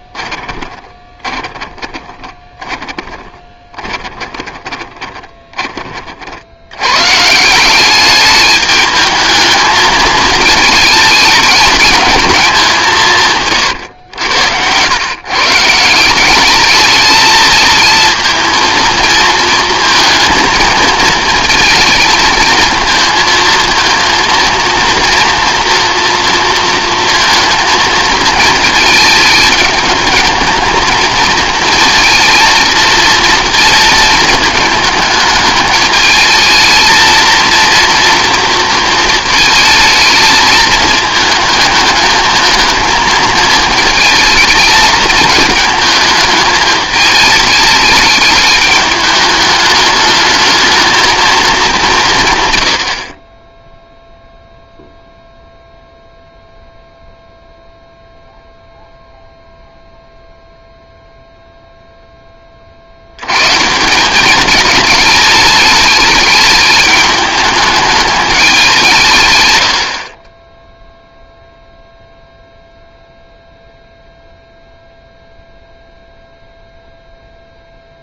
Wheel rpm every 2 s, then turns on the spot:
20, 20, 20, 100, 210, 220, 180, 110, 220, 230, 220, 220, 230, 230, 220, 230, 230, 220, 220, 230, 210, 220, 220, 220, 210, 220, 80, 0, 0, 0, 0, 60, 210, 210, 180, 0, 0, 0, 0.
0-6